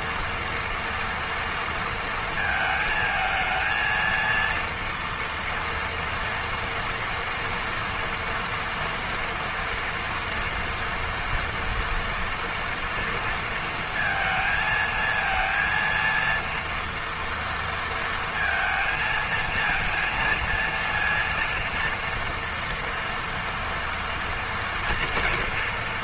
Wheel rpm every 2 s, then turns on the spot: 230, 220, 230, 230, 230, 240, 230, 220, 230, 230, 230, 230, 230.
none